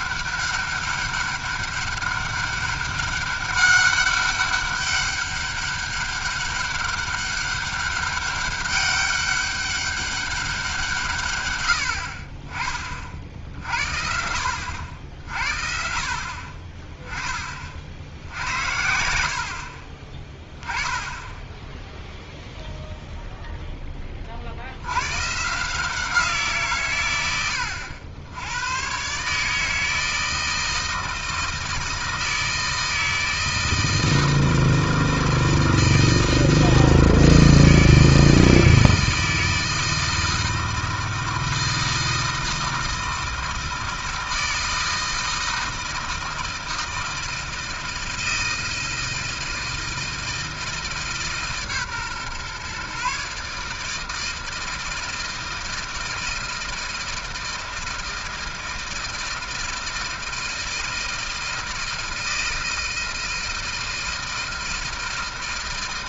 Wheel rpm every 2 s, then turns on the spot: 200, 200, 200, 200, 200, 190, 40, 80, 40, 80, 10, 0, 60, 150, 100, 160, 160, 160, 160, 160, 160, 160, 160, 160, 160, 160, 130, 160, 160, 160, 160, 160, 160.
none